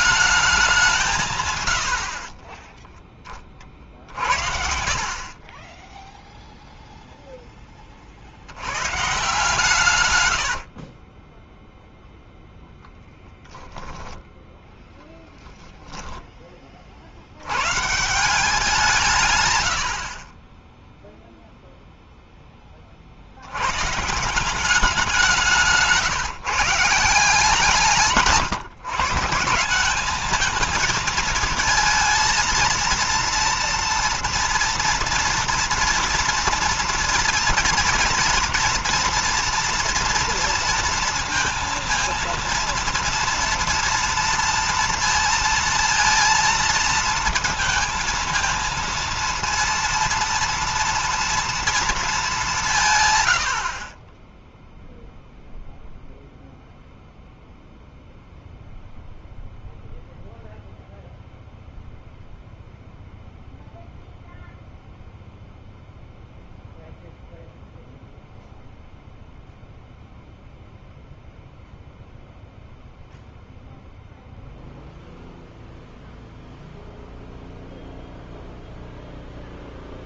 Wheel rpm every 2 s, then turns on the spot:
190, 20, 50, 0, 110, 50, 0, 0, 40, 160, 10, 20, 180, 170, 150, 220, 230, 230, 230, 240, 230, 230, 230, 230, 230, 230, 160, 0, 0, 0, 0, 0, 0, 0, 0, 0, 0, 0, 0, 0.
2-6 10-12